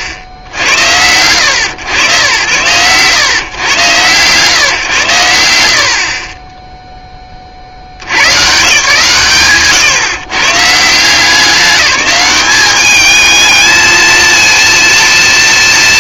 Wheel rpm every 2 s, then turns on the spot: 60, 100, 130, 10, 140, 150, 210, 230.
none